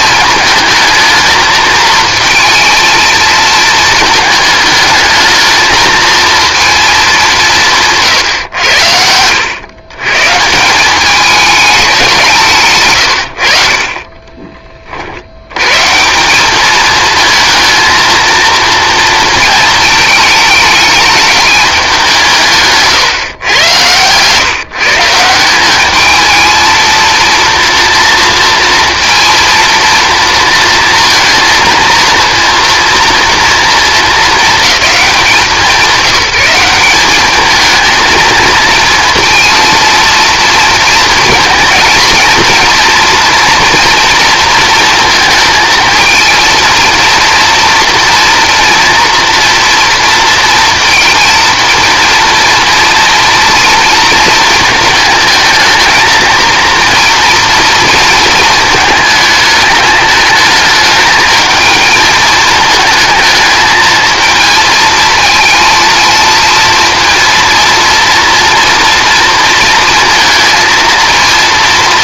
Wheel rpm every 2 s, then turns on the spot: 220, 220, 220, 210, 90, 190, 110, 40, 220, 230, 220, 140, 150, 220, 230, 230, 230, 200, 190, 230, 230, 230, 230, 230, 230, 230, 230, 220, 230, 220, 220, 230, 220, 230, 230, 220.
22-24